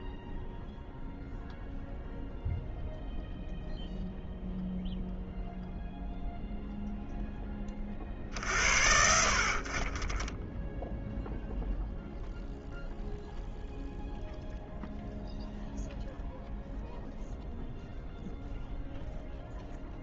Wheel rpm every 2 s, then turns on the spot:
0, 0, 0, 60, 10, 0, 0, 0, 0, 0.
none